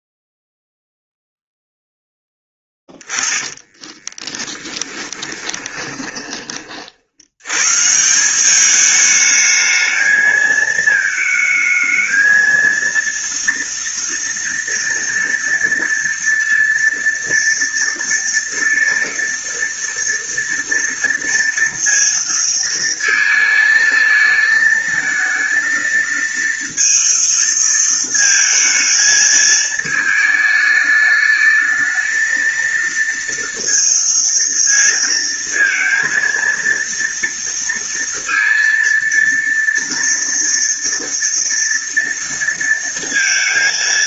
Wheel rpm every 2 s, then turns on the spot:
0, 10, 10, 30, 190, 220, 230, 230, 230, 230, 230, 230, 220, 230, 220, 220, 220, 230, 230, 230, 230, 230.
2-6